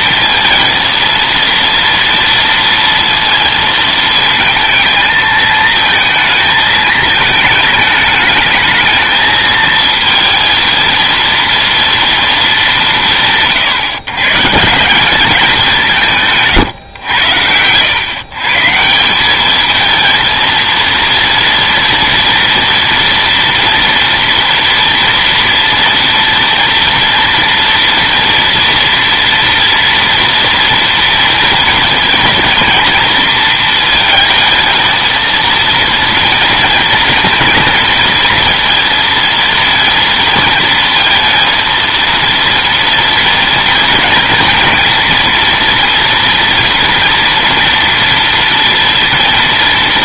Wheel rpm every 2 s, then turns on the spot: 230, 230, 220, 220, 210, 230, 190, 150, 130, 160, 230, 230, 240, 230, 240, 230, 230, 220, 230, 230, 220, 230, 240, 230, 230.
none